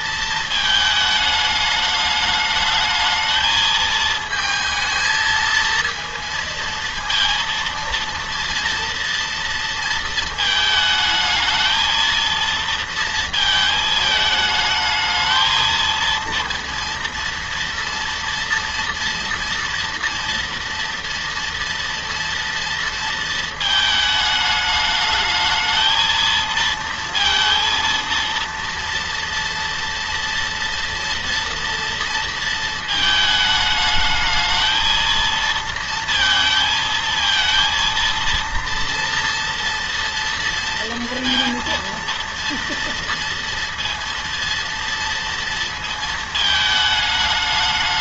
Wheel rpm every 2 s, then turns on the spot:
220, 210, 230, 230, 230, 220, 230, 220, 230, 230, 230, 230, 220, 230, 230, 230, 230, 220, 220, 230, 230, 230, 230, 220.
none